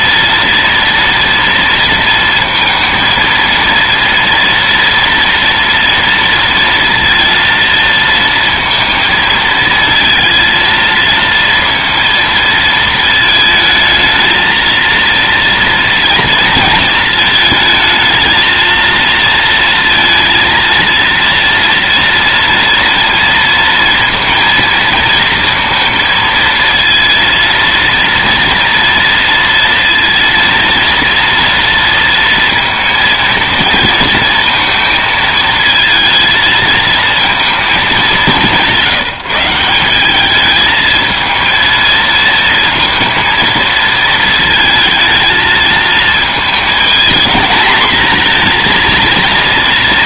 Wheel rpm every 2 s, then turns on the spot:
230, 230, 230, 230, 230, 230, 220, 230, 230, 220, 230, 230, 230, 230, 230, 230, 230, 230, 230, 180, 220, 230, 220, 220, 230.
none